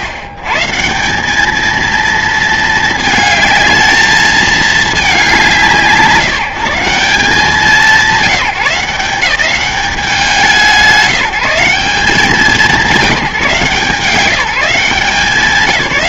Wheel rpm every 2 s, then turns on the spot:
140, 230, 220, 170, 180, 200, 190, 170.
none